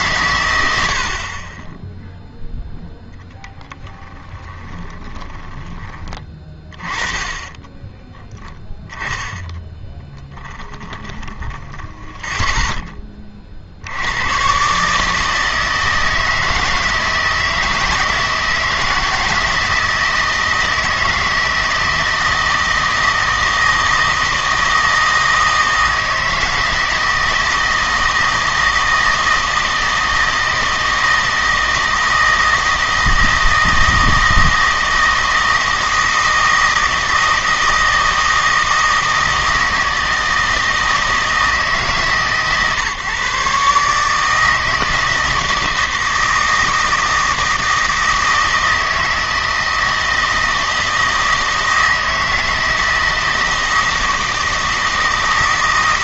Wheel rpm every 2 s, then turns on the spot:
90, 0, 20, 30, 10, 10, 10, 130, 160, 160, 160, 160, 160, 160, 160, 160, 160, 160, 160, 160, 160, 140, 160, 160, 160, 160, 160, 160.
4-6 10-12